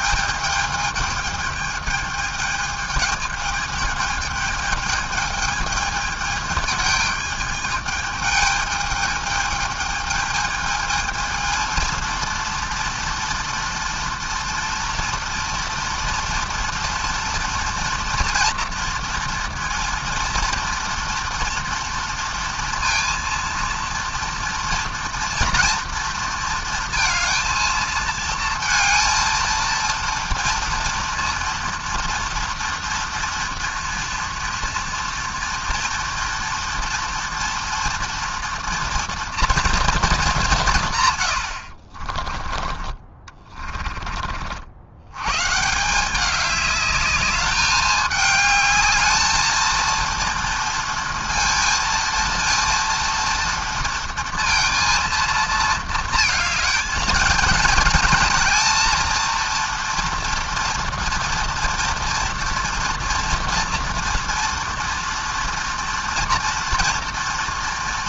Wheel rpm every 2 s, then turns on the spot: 210, 220, 220, 210, 210, 220, 230, 230, 230, 230, 230, 230, 230, 230, 220, 230, 230, 240, 230, 240, 160, 30, 80, 210, 220, 230, 230, 230, 220, 230, 230, 230, 230, 230.
none